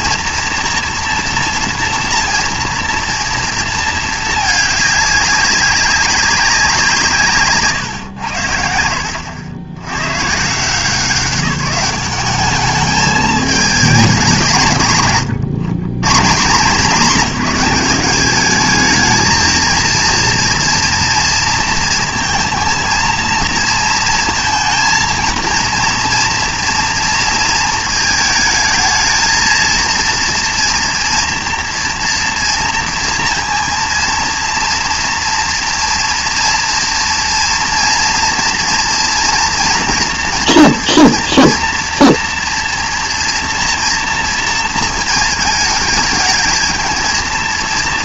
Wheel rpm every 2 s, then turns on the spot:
230, 230, 210, 180, 70, 160, 210, 170, 200, 220, 240, 220, 230, 230, 220, 230, 230, 230, 230, 230, 240, 230, 230, 220.
none